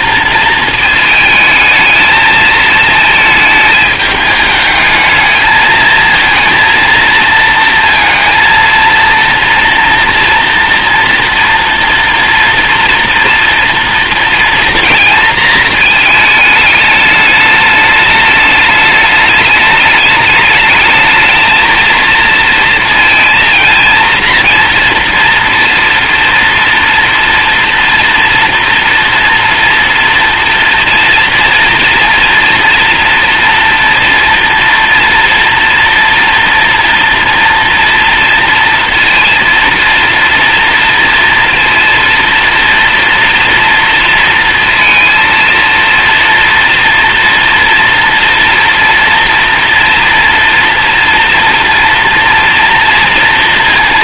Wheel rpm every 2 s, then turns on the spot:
220, 220, 220, 230, 230, 230, 230, 230, 210, 210, 220, 230, 230, 230, 240, 230, 230, 230, 230, 240, 230, 240, 230, 230, 230, 230, 230.
none